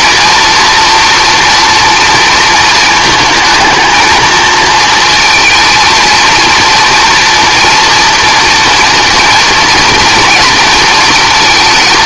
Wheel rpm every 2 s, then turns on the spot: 240, 230, 230, 230, 240, 230.
none